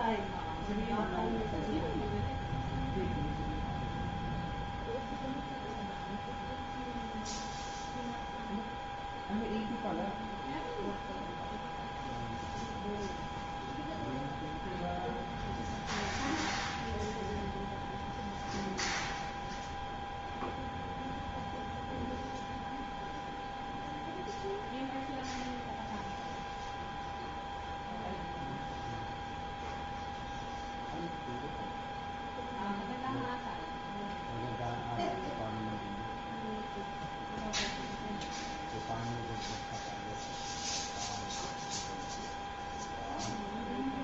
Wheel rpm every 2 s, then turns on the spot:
0, 0, 0, 0, 0, 0, 0, 0, 0, 0, 0, 0, 0, 0, 0, 0, 0, 0, 0, 0, 0, 0.
none